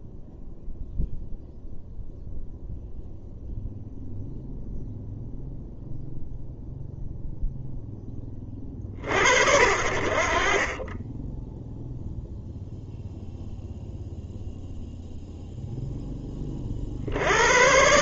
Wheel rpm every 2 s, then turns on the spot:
0, 0, 0, 0, 50, 30, 0, 0, 40.
none